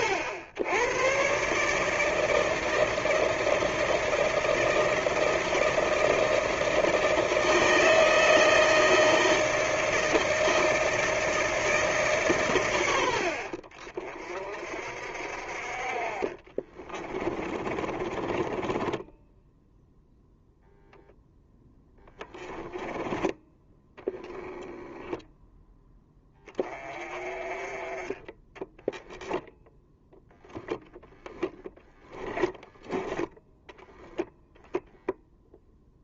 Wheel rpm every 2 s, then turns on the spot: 90, 160, 160, 160, 160, 160, 110, 50, 30, 20, 0, 10, 10, 20, 10, 0, 10, 0.
16-20 24-26 28-30 32-34